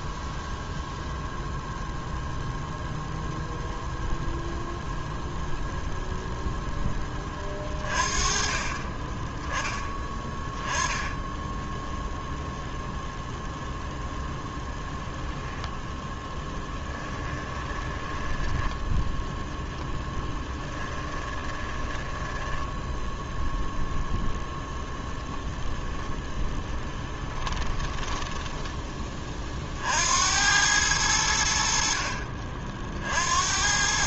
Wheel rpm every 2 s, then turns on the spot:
0, 0, 0, 0, 30, 10, 0, 0, 10, 10, 10, 10, 10, 20, 10, 90, 60.
16-24 26-30